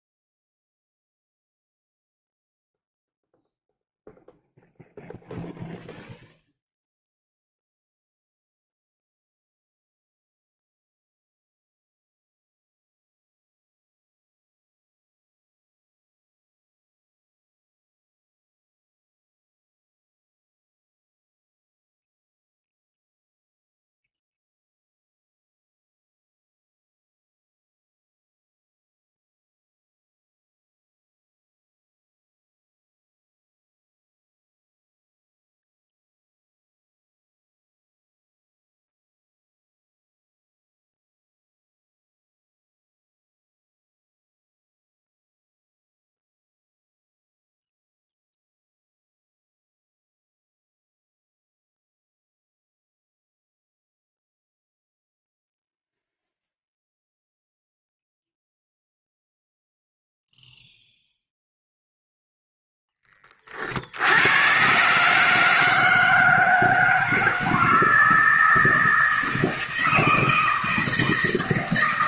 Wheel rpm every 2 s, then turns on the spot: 0, 0, 0, 0, 0, 0, 0, 0, 0, 0, 0, 0, 0, 0, 0, 0, 0, 0, 0, 0, 0, 0, 0, 0, 0, 0, 0, 0, 0, 0, 0, 0, 120, 160, 160, 160.
none